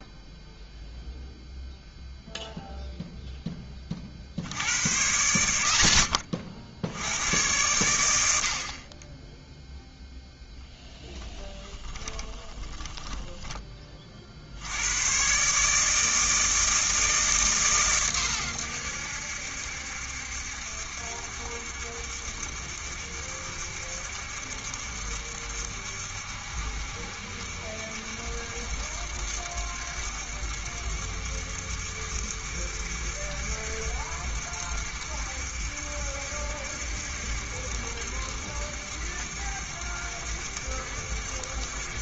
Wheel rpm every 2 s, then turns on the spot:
0, 0, 90, 80, 40, 20, 20, 90, 160, 90, 70, 70, 70, 70, 70, 70, 70, 70, 70, 70, 70.
10-14